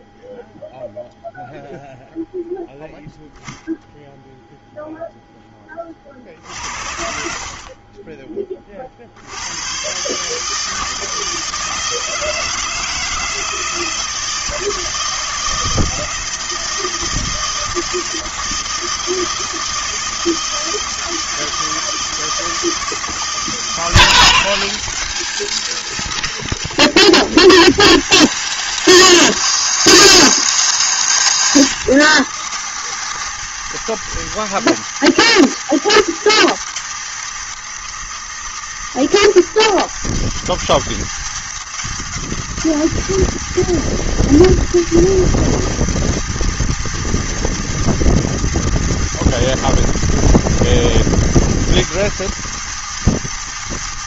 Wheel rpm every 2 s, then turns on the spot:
0, 0, 0, 60, 30, 150, 160, 160, 160, 160, 160, 160, 170, 170, 160, 160, 190, 210, 210, 170, 180, 200, 210, 210, 210, 210, 210.
6-8